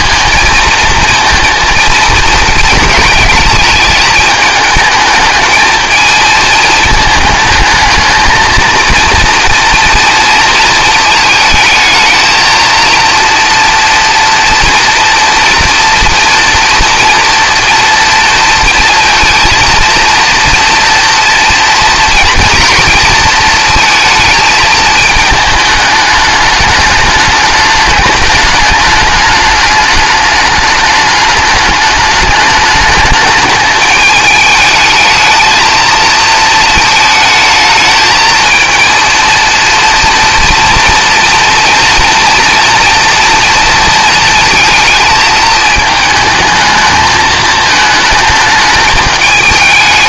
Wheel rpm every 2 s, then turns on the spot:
230, 230, 220, 220, 230, 220, 230, 230, 230, 230, 240, 230, 220, 210, 210, 210, 210, 220, 220, 230, 230, 240, 230, 220, 210.
none